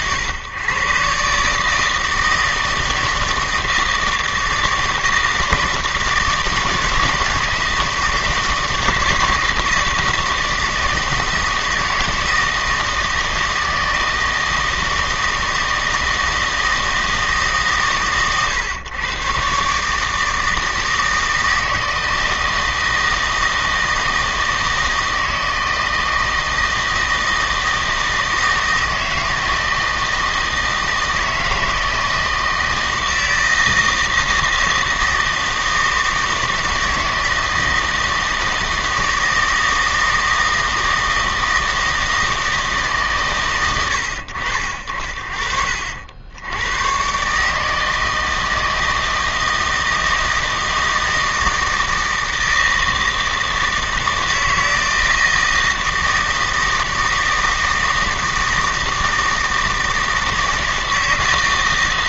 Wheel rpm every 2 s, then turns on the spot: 120, 160, 160, 160, 160, 160, 160, 160, 160, 120, 160, 160, 160, 160, 160, 160, 160, 160, 160, 160, 160, 160, 60, 100, 160, 160, 160, 160, 160, 160, 160.
none